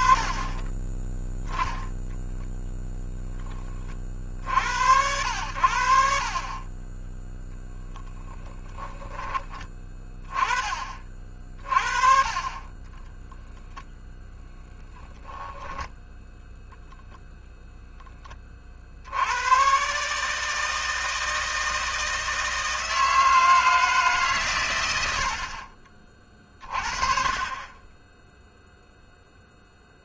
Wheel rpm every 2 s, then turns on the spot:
10, 0, 80, 20, 10, 40, 20, 10, 10, 70, 160, 160, 90, 40, 0.
12-14